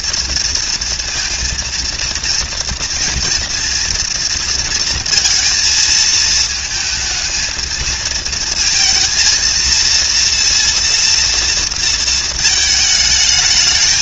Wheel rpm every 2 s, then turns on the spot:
230, 230, 230, 220, 220, 230, 220.
none